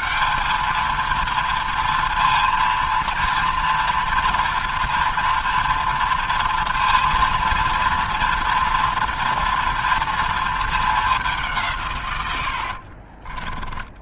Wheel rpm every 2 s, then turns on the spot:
220, 230, 230, 230, 230, 230, 100.
none